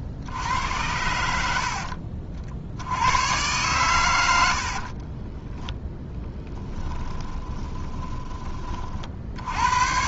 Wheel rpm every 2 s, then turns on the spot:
80, 70, 60, 20, 30.
4-8